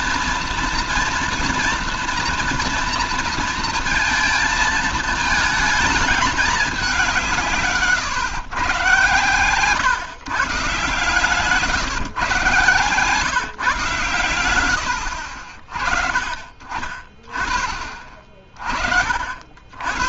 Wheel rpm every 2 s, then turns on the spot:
230, 230, 230, 200, 130, 140, 130, 110, 40, 40.
none